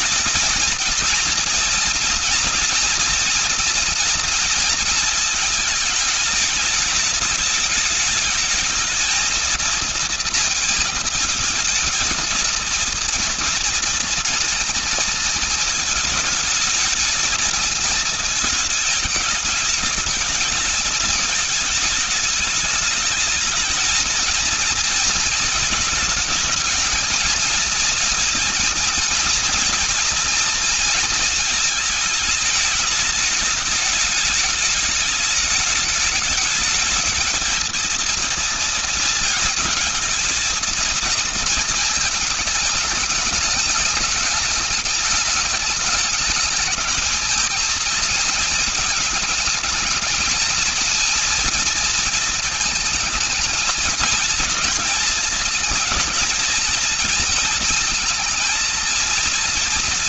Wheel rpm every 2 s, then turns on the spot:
230, 240, 220, 210, 220, 230, 230, 220, 220, 210, 210, 210, 230, 220, 230, 230, 210, 210, 220, 230, 230, 210, 210, 220, 220, 230, 220, 220, 230, 230.
none